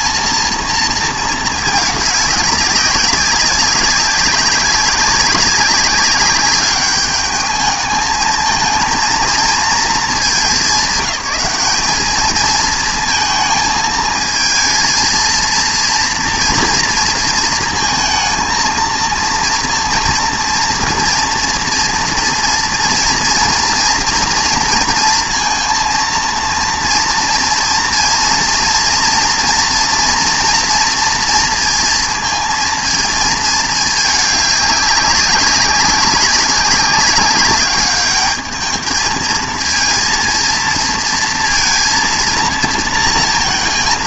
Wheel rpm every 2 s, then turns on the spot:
230, 200, 200, 200, 220, 200, 220, 230, 230, 230, 230, 240, 230, 230, 230, 230, 230, 200, 190, 220, 230, 230.
none